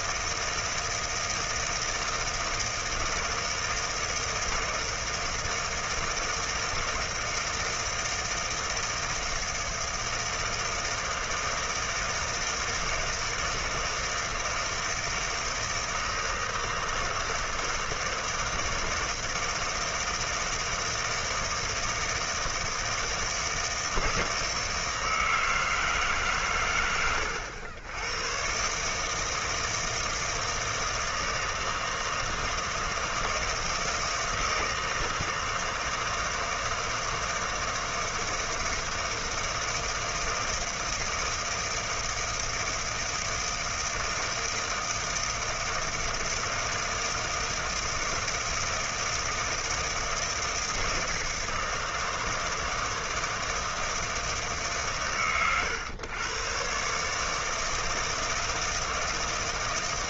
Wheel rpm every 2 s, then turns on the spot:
160, 160, 160, 160, 160, 160, 160, 160, 160, 160, 160, 160, 160, 120, 110, 160, 160, 160, 160, 160, 160, 160, 160, 160, 160, 160, 160, 150, 110, 160.
none